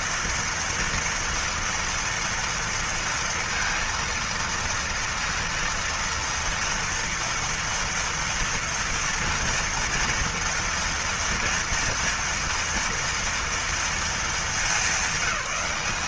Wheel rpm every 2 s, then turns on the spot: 230, 230, 230, 230, 230, 240, 240, 210.
none